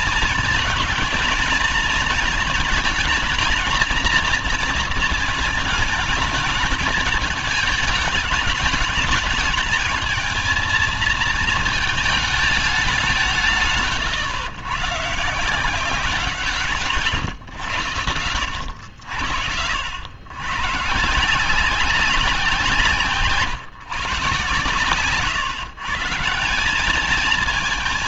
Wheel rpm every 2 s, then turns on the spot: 220, 220, 230, 210, 210, 220, 210, 120, 170, 80, 130, 170, 130, 180.
none